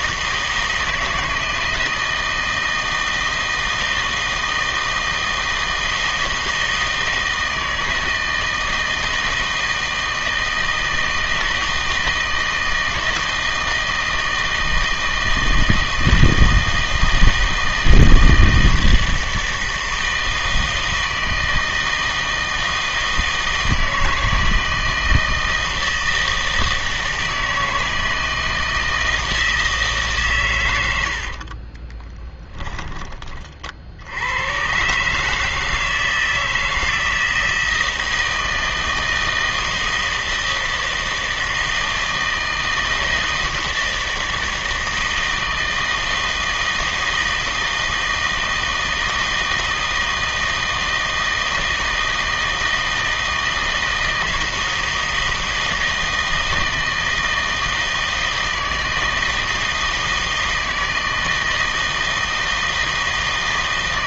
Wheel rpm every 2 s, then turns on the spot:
160, 160, 160, 160, 160, 160, 160, 160, 160, 160, 160, 160, 160, 160, 160, 110, 10, 110, 160, 160, 160, 160, 160, 160, 160, 160, 160, 160, 160, 160, 160, 160.
32-34